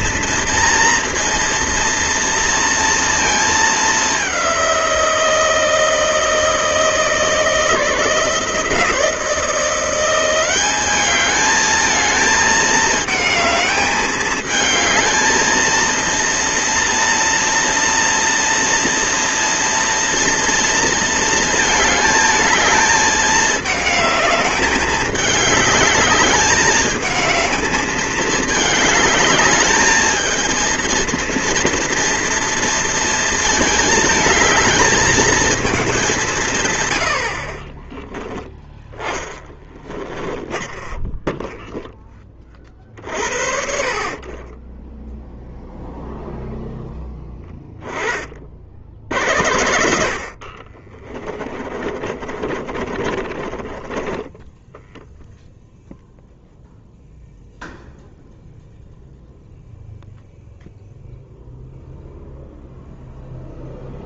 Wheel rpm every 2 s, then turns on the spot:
230, 230, 190, 160, 160, 190, 220, 220, 230, 240, 230, 220, 210, 210, 210, 220, 230, 220, 160, 10, 20, 30, 20, 0, 50, 50, 30, 10, 0, 0, 0, 0.
40-42 50-56